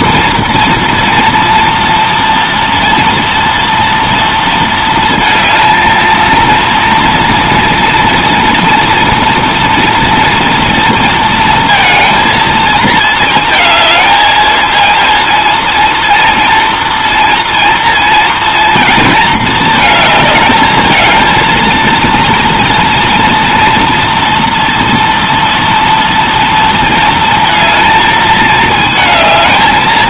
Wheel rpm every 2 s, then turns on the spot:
230, 230, 230, 230, 230, 230, 220, 220, 230, 230, 220, 230, 240, 230, 220.
none